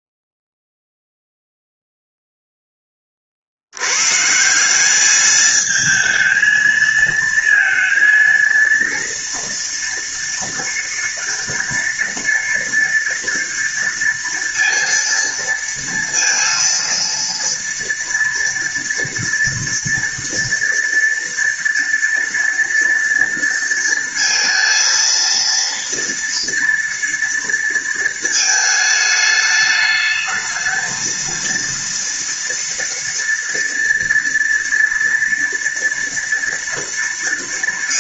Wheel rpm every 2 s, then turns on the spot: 0, 10, 190, 220, 230, 230, 230, 230, 230, 230, 230, 230, 230, 230, 220, 230, 230, 230, 230.
none